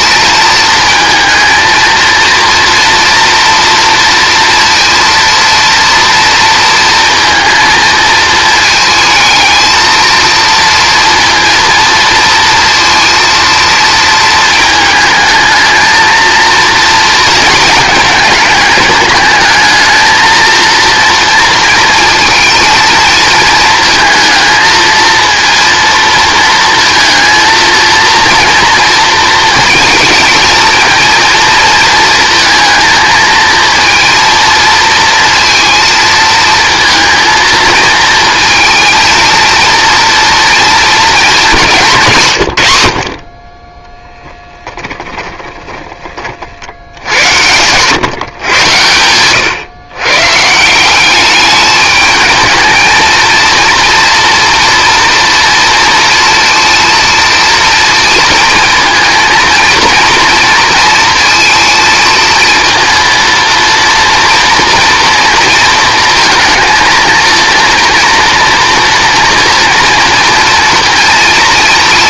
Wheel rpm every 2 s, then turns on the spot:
220, 230, 230, 230, 220, 230, 230, 220, 230, 210, 230, 230, 230, 230, 230, 220, 220, 230, 230, 230, 220, 80, 10, 70, 110, 160, 220, 230, 230, 230, 230, 230, 230, 230, 230, 230.
44-46